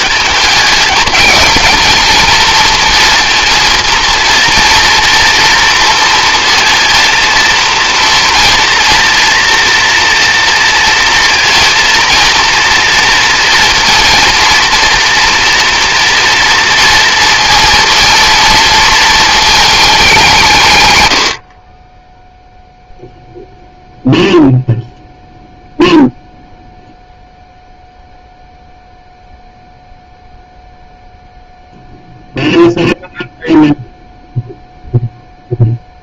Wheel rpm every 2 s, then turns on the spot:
220, 230, 230, 230, 240, 230, 230, 230, 230, 230, 120, 0, 0, 0, 0, 0, 0, 0.
none